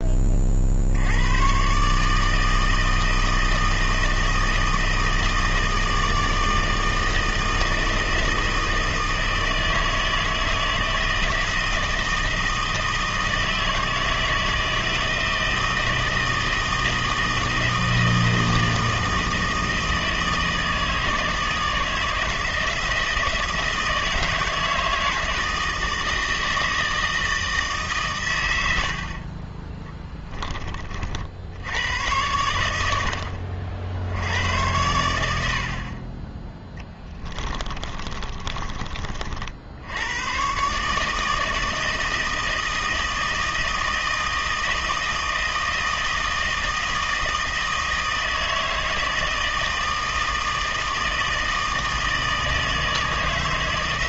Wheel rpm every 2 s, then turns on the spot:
50, 160, 160, 160, 160, 160, 160, 160, 160, 160, 160, 160, 160, 160, 90, 20, 90, 90, 20, 40, 130, 160, 160, 160, 160, 160, 160.
38-40